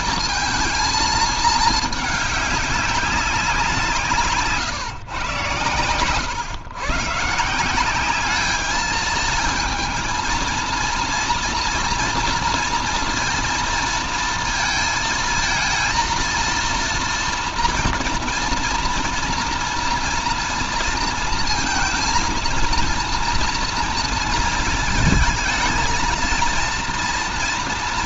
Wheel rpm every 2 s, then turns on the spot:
230, 210, 150, 120, 200, 230, 230, 220, 230, 230, 230, 230, 230, 230.
none